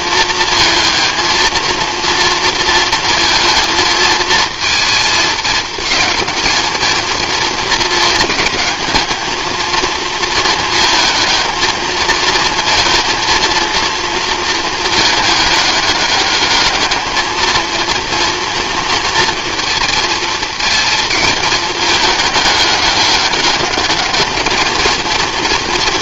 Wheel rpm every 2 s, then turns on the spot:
230, 230, 220, 220, 220, 220, 220, 220, 210, 230, 220, 210, 220.
none